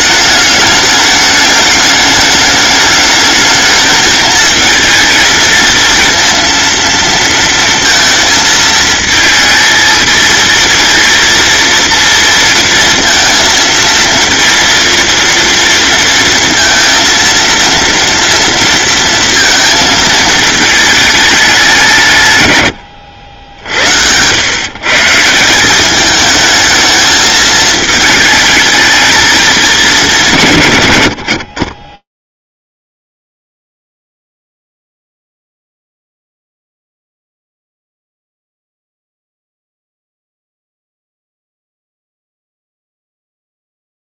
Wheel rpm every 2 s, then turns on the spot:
210, 210, 220, 230, 220, 230, 230, 230, 230, 230, 220, 100, 130, 220, 220, 100, 0, 0, 0, 0, 0, 0.
none